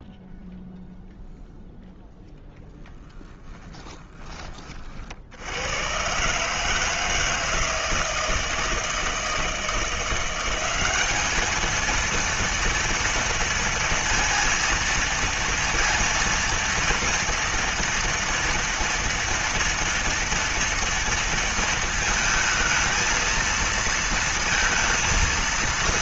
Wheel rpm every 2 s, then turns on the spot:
0, 0, 20, 140, 160, 180, 230, 230, 230, 240, 230, 220, 230.
none